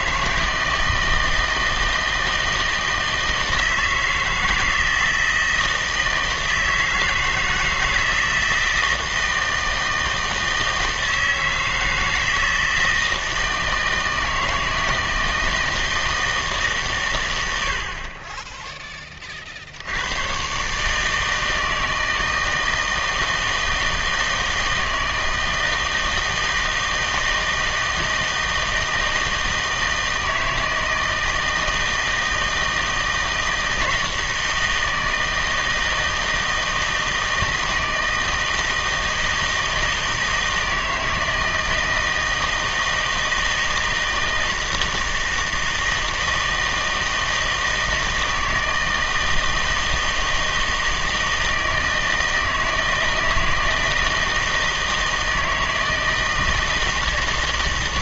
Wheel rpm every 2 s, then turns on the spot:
160, 160, 160, 160, 160, 160, 160, 160, 140, 10, 130, 160, 160, 160, 160, 160, 160, 160, 160, 160, 160, 160, 160, 160, 160, 160, 160, 160, 160.
none